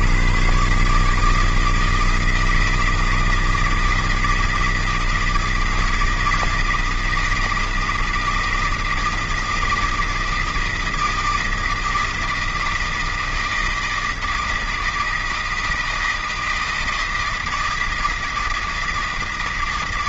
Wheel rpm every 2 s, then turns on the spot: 110, 160, 160, 160, 160, 160, 160, 160, 160, 160.
none